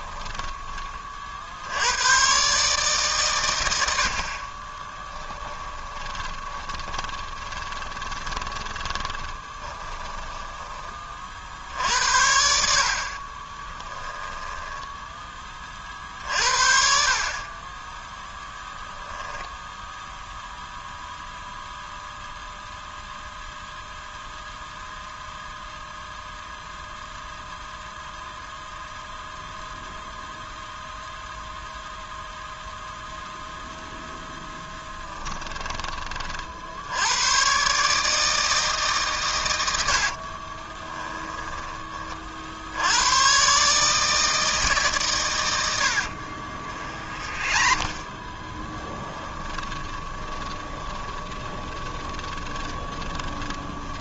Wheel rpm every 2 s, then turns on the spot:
20, 140, 20, 20, 20, 20, 70, 10, 40, 0, 0, 0, 0, 0, 0, 0, 0, 10, 70, 150, 20, 80, 150, 40, 10, 20, 20.
4-10 14-16 34-36 40-42 46-54